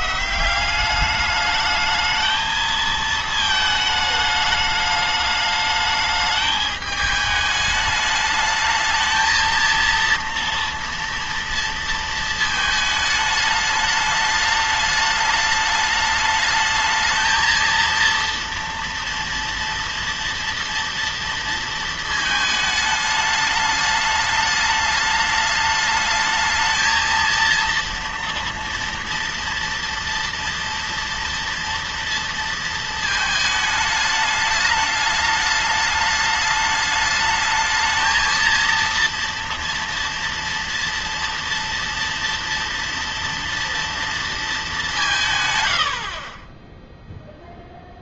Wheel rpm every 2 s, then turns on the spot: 180, 220, 210, 210, 220, 230, 220, 210, 220, 230, 230, 220, 210, 220, 230, 230, 230, 210, 210, 230, 230, 230, 210, 20.
none